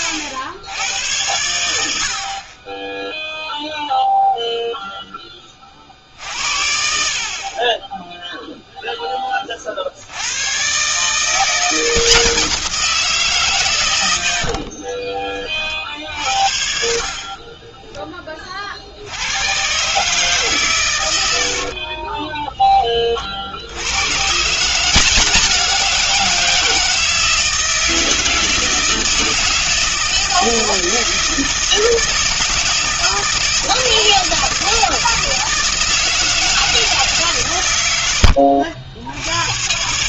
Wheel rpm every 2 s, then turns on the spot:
90, 30, 0, 50, 0, 130, 170, 40, 60, 40, 140, 20, 160, 170, 160, 160, 160, 160, 160, 70.
14-16